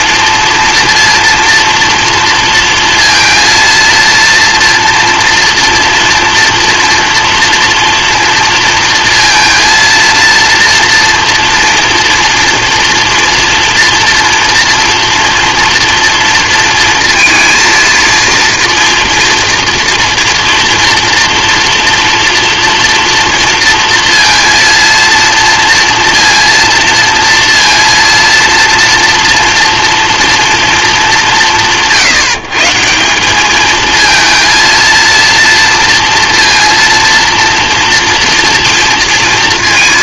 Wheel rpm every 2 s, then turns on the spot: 230, 230, 230, 230, 230, 230, 230, 230, 230, 230, 240, 240, 230, 230, 240, 230, 160, 230, 230, 230.
none